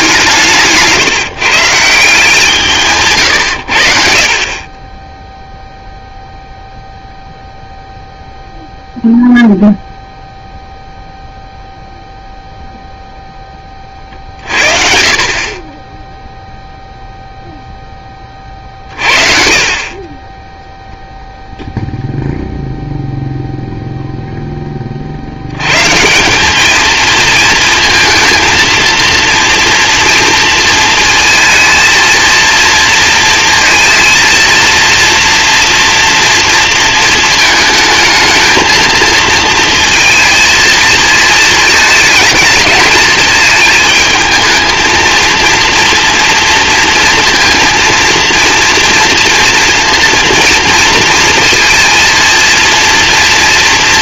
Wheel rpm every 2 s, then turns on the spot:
150, 170, 30, 0, 0, 0, 0, 50, 0, 40, 10, 0, 10, 200, 230, 230, 230, 230, 230, 220, 230, 220, 220, 230, 230, 230, 230.
0-2